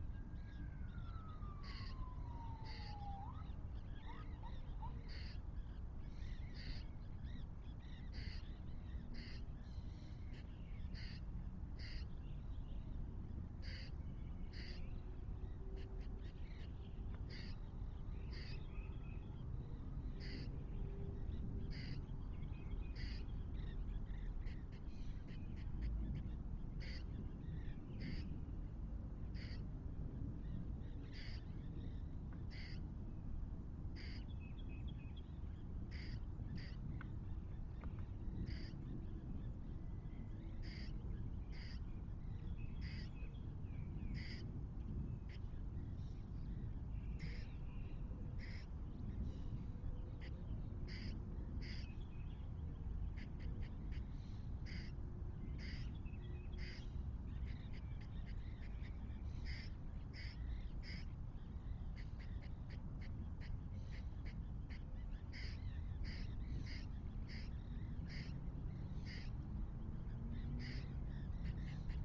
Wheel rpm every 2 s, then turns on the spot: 0, 0, 0, 0, 0, 0, 0, 0, 0, 0, 0, 0, 0, 0, 0, 0, 0, 0, 0, 0, 0, 0, 0, 0, 0, 0, 0, 0, 0, 0, 0, 0, 0, 0, 0, 0.
none